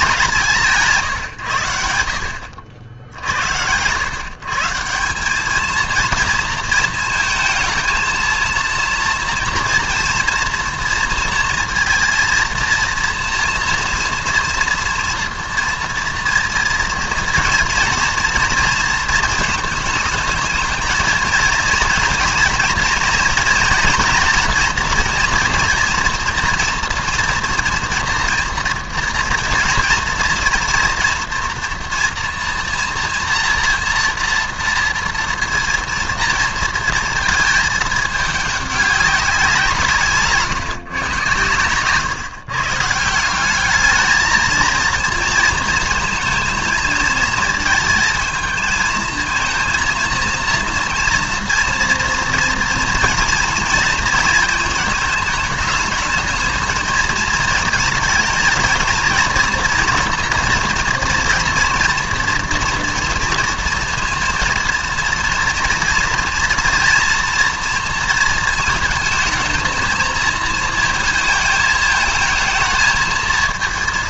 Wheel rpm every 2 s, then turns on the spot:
180, 70, 160, 230, 230, 230, 230, 240, 230, 230, 220, 240, 240, 240, 230, 230, 240, 230, 230, 210, 140, 140, 230, 230, 220, 230, 240, 220, 220, 230, 230, 230, 230, 240, 220, 220, 220.
none